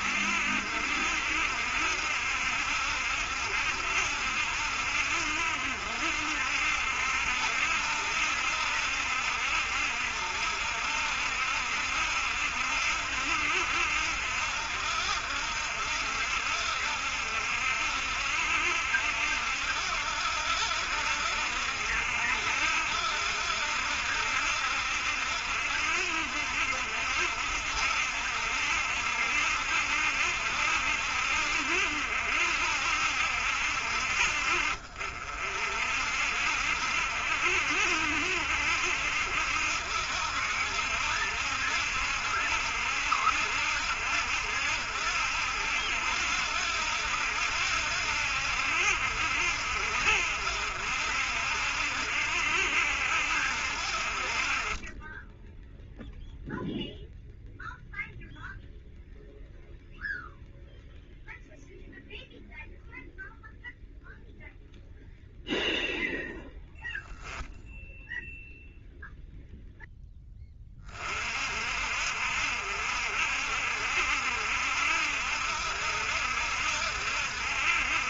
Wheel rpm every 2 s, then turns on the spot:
70, 70, 70, 70, 70, 70, 70, 70, 70, 70, 70, 70, 70, 60, 70, 70, 70, 60, 60, 70, 60, 70, 70, 70, 70, 70, 70, 40, 0, 0, 0, 0, 0, 20, 0, 10, 60, 70, 70.
none